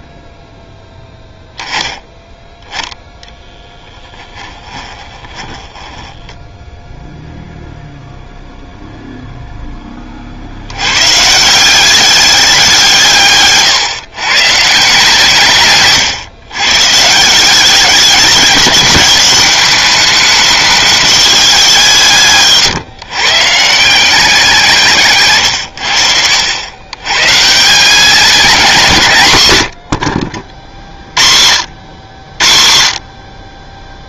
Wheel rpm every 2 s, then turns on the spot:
10, 0, 10, 0, 0, 120, 170, 160, 150, 200, 210, 150, 140, 130, 170, 60, 50.
4-6